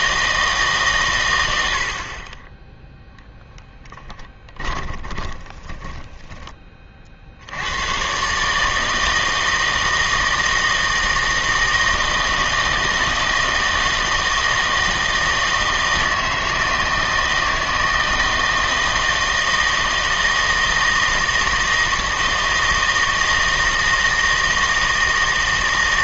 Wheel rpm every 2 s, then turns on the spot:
140, 10, 10, 30, 150, 160, 160, 160, 160, 160, 160, 160, 160.
4-6